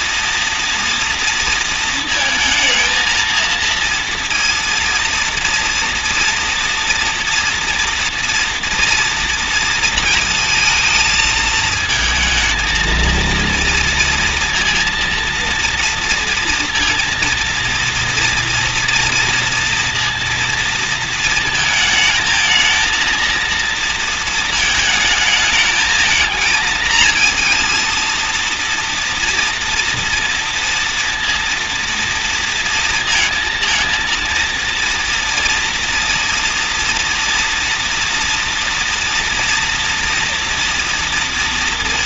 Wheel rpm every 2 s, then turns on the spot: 230, 230, 230, 240, 240, 230, 230, 230, 230, 230, 230, 220, 220, 220, 230, 230, 230, 230, 230, 230, 230.
none